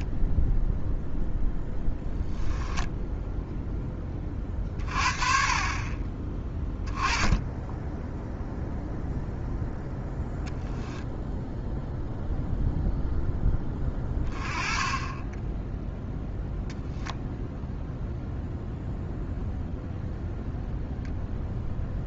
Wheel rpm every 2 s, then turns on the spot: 0, 0, 40, 10, 0, 0, 0, 10, 0, 0, 0.
none